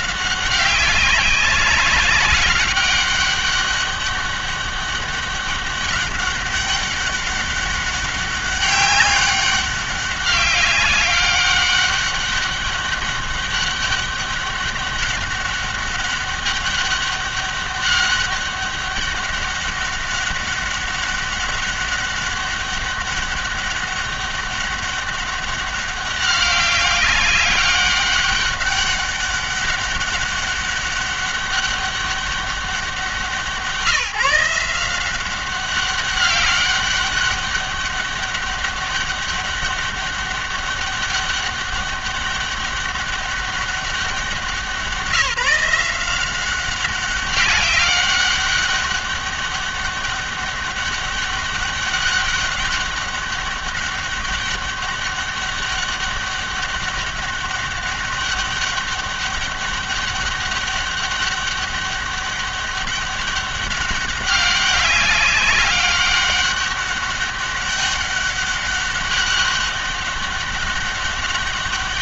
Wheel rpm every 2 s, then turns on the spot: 190, 200, 200, 200, 200, 200, 200, 200, 200, 200, 200, 200, 200, 200, 200, 200, 190, 170, 200, 200, 200, 200, 190, 190, 200, 200, 200, 200, 200, 200, 200, 200, 200, 200, 200, 200.
none